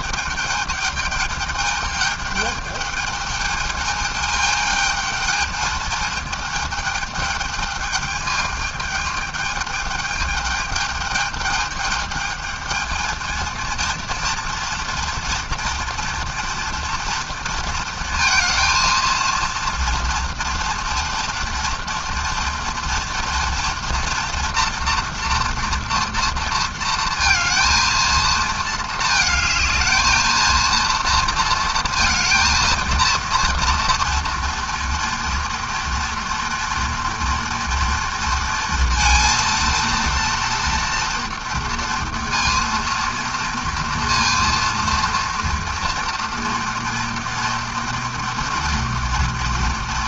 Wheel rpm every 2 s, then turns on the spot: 220, 210, 220, 220, 210, 210, 220, 230, 240, 230, 230, 230, 240, 230, 220, 230, 230, 230, 230, 230, 230, 230, 230, 240, 230.
none